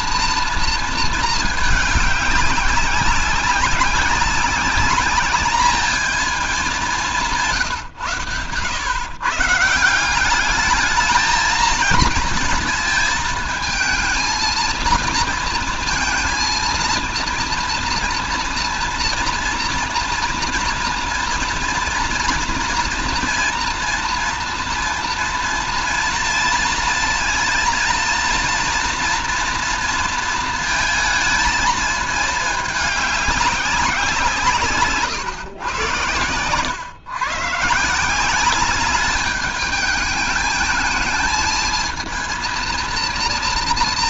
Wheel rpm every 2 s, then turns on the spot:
230, 200, 200, 210, 130, 200, 230, 230, 230, 240, 230, 230, 230, 230, 230, 230, 210, 170, 120, 200, 210, 230.
none